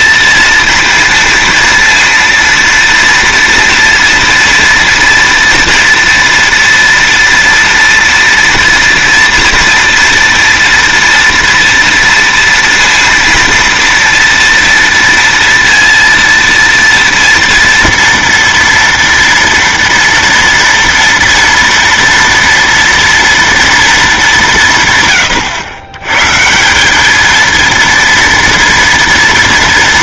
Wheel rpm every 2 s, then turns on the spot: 230, 230, 230, 240, 230, 230, 230, 230, 230, 230, 230, 230, 170, 170, 240.
none